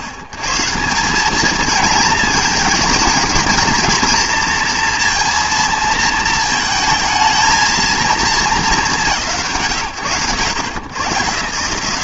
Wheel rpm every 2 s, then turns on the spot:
120, 210, 230, 220, 210, 120.
none